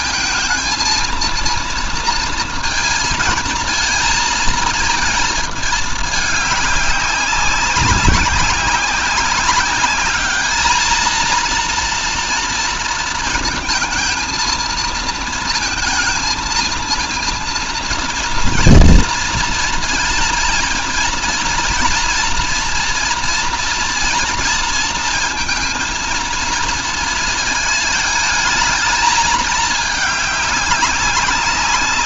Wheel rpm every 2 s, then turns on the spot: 230, 230, 230, 190, 190, 230, 230, 230, 230, 230, 230, 230, 230, 230, 220, 200.
none